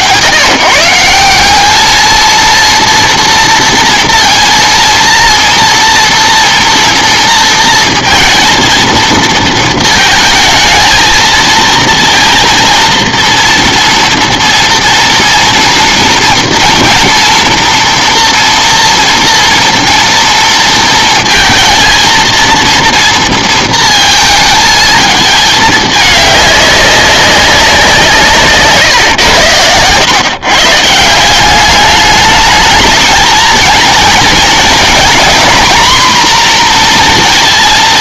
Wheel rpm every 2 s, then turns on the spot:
160, 230, 230, 230, 230, 220, 240, 230, 230, 230, 230, 230, 220, 200, 140, 150, 220, 230, 240.
none